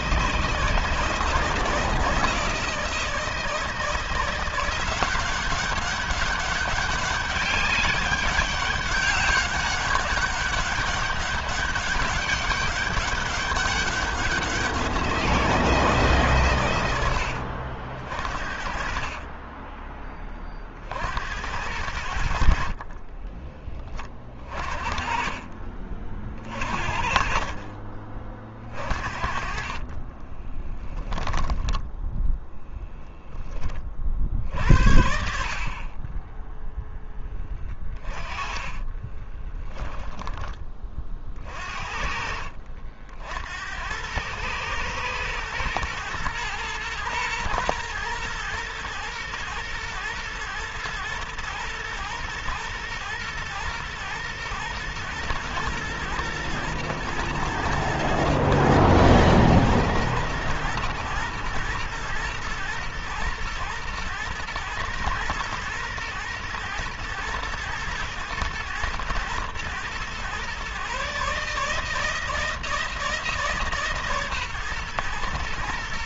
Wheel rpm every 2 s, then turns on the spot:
160, 160, 190, 200, 200, 200, 200, 170, 80, 30, 70, 30, 40, 40, 40, 0, 10, 70, 10, 10, 30, 60, 120, 120, 120, 110, 120, 120, 120, 120, 110, 120, 120, 120, 110, 140, 160, 120.
18-20 22-30 38-40